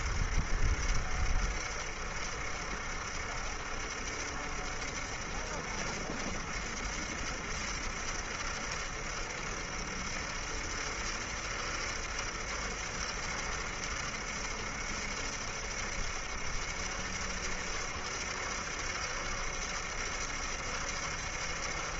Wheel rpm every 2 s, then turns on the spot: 70, 70, 70, 70, 70, 70, 70, 70, 70, 70, 70.
none